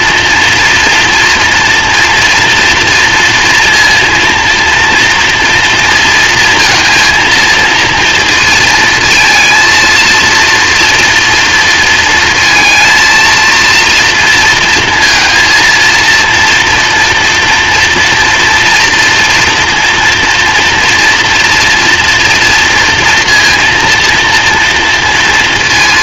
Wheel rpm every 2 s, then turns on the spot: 230, 230, 230, 230, 230, 230, 230, 230, 230, 240, 230, 230, 230.
none